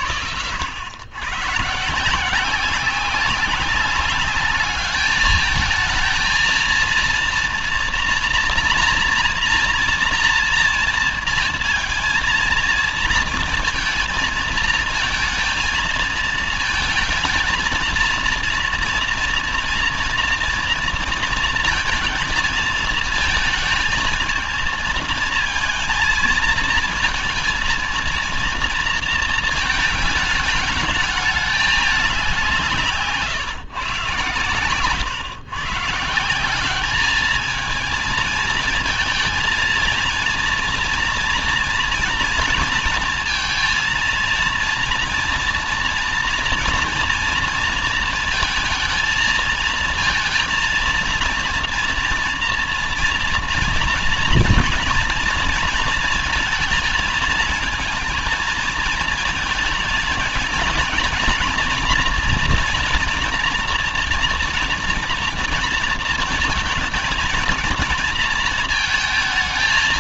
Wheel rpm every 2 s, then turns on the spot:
80, 180, 210, 230, 240, 240, 230, 220, 220, 230, 240, 230, 220, 230, 230, 210, 180, 130, 180, 220, 230, 230, 230, 230, 220, 230, 240, 230, 220, 230, 230, 230, 240, 230, 230.
none